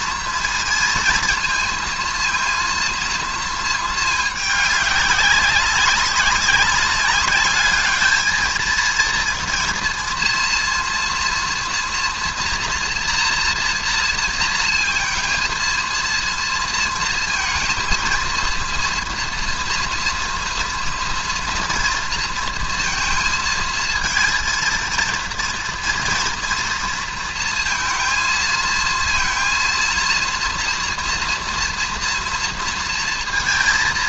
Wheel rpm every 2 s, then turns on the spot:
230, 230, 200, 200, 230, 230, 240, 230, 230, 230, 240, 230, 230, 230, 230, 230, 230.
none